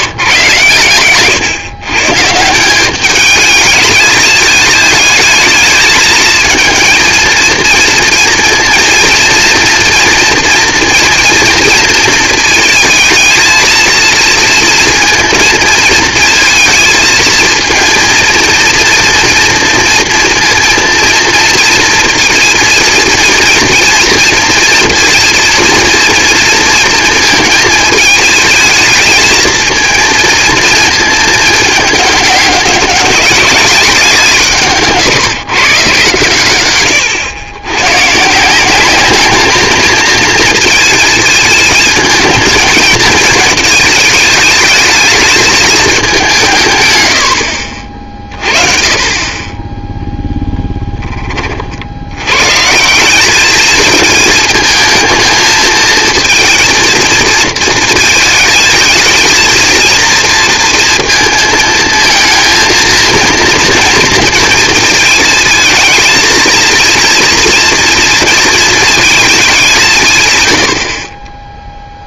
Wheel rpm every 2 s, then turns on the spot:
120, 170, 220, 220, 230, 240, 230, 230, 220, 230, 230, 230, 230, 230, 220, 230, 200, 160, 110, 170, 230, 220, 220, 140, 30, 10, 140, 220, 230, 220, 230, 220, 230, 230, 230, 150.
50-52